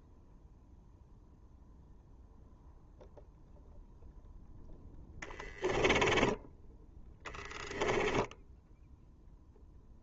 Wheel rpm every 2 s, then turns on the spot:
0, 0, 10, 10, 0.
6-8